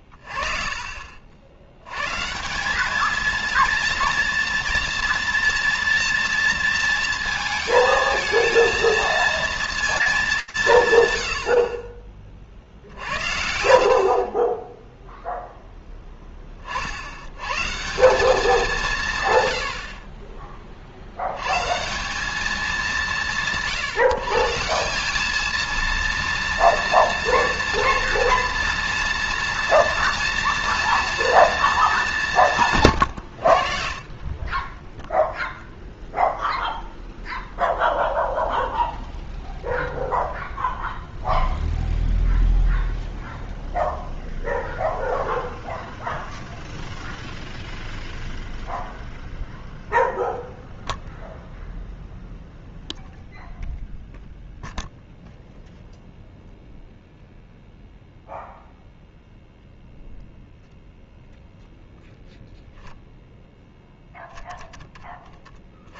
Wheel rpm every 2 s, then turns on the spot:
20, 150, 230, 230, 220, 210, 50, 30, 20, 190, 30, 200, 160, 230, 240, 230, 170, 30, 0, 0, 0, 0, 0, 0, 0, 0, 0, 0, 0, 0, 0, 0, 20.
none